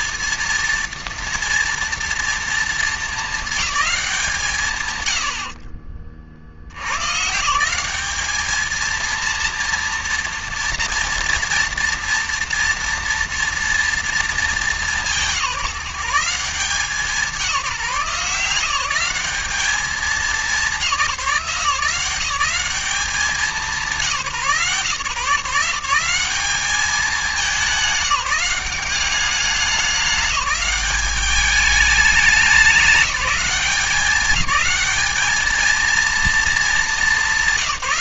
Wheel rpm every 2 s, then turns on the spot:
230, 220, 120, 100, 230, 230, 230, 170, 170, 180, 170, 190, 140, 200, 190, 200, 200, 210, 220.
none